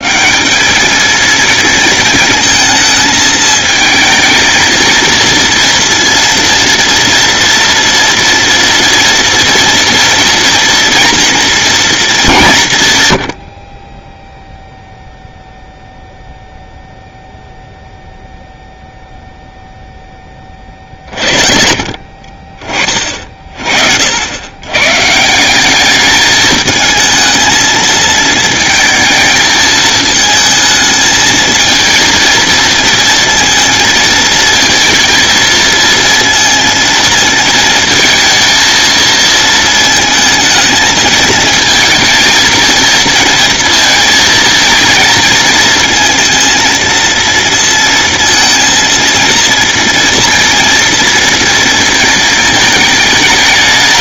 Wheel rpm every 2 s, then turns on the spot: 200, 220, 230, 240, 240, 230, 150, 0, 0, 0, 40, 30, 120, 220, 220, 220, 230, 230, 230, 220, 220, 230, 220, 230, 230, 230, 220.
none